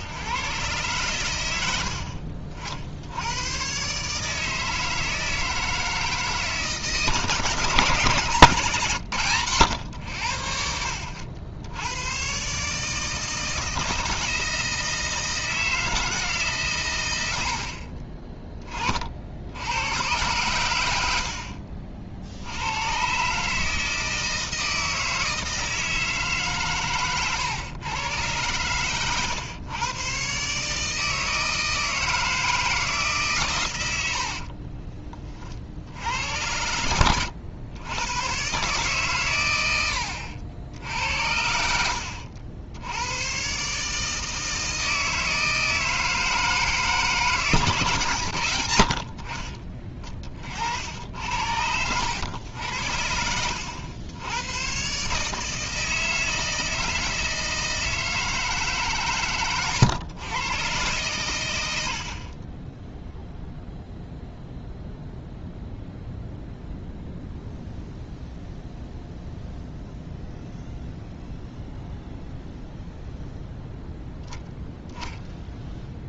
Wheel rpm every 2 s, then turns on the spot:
110, 70, 160, 150, 130, 70, 150, 160, 110, 40, 100, 100, 160, 130, 110, 150, 160, 40, 90, 130, 70, 80, 160, 160, 150, 40, 90, 110, 160, 160, 110, 0, 0, 0, 0, 0, 0, 0.
34-36